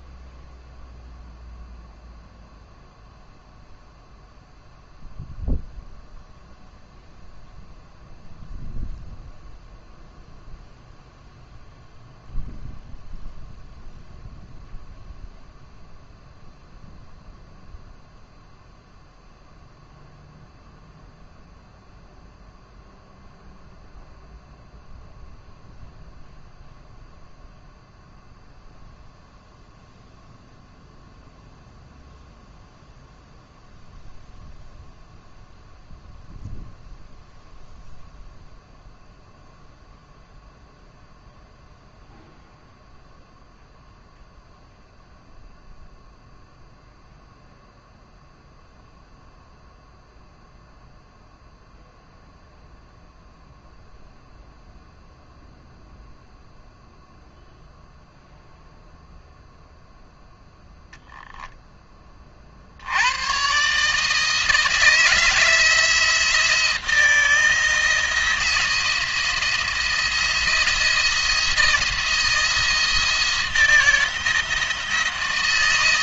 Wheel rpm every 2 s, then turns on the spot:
0, 0, 0, 0, 0, 0, 0, 0, 0, 0, 0, 0, 0, 0, 0, 0, 0, 0, 0, 0, 0, 0, 0, 0, 0, 0, 0, 0, 0, 0, 0, 80, 160, 170, 170, 170, 160, 160.
none